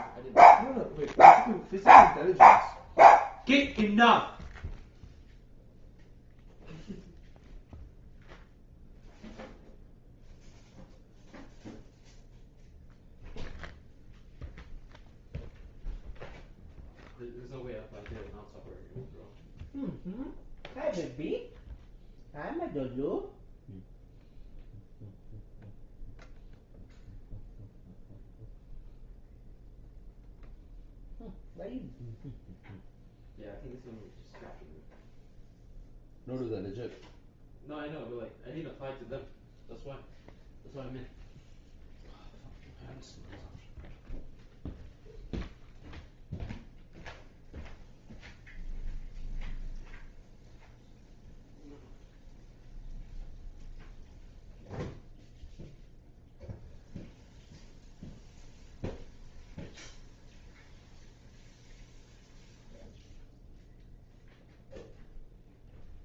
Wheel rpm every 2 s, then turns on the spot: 0, 0, 0, 0, 0, 0, 0, 0, 0, 0, 0, 0, 0, 0, 0, 0, 0, 0, 0, 0, 0, 0, 0, 0, 0, 0, 0, 0, 0, 0, 0, 0, 0.
none